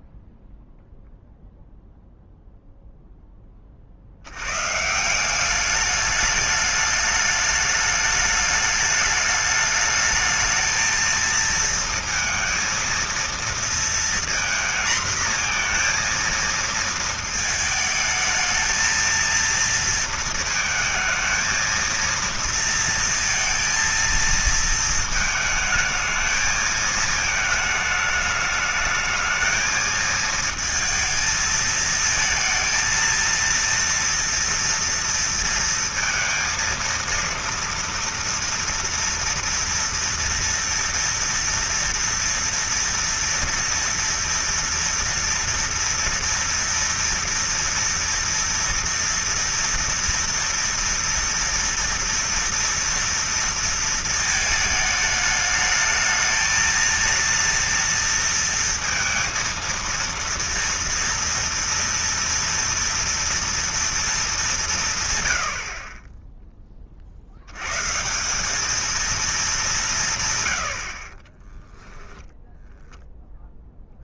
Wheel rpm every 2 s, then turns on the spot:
0, 0, 160, 210, 210, 220, 230, 230, 230, 220, 220, 230, 220, 220, 210, 220, 230, 230, 230, 230, 230, 230, 230, 230, 230, 230, 230, 220, 230, 230, 230, 230, 170, 50, 220, 70, 10.
none